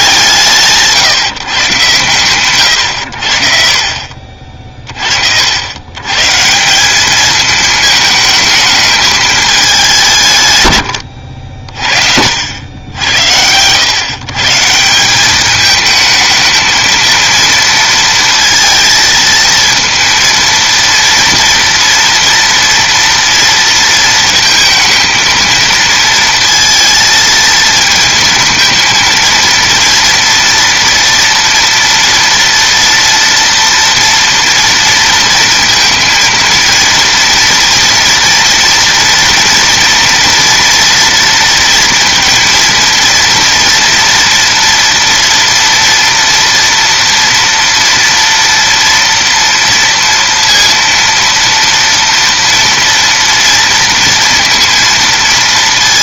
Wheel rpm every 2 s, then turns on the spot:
170, 110, 40, 180, 220, 100, 90, 160, 220, 230, 230, 230, 230, 230, 230, 230, 230, 230, 230, 230, 230, 230, 240, 230, 230, 230, 230, 230.
none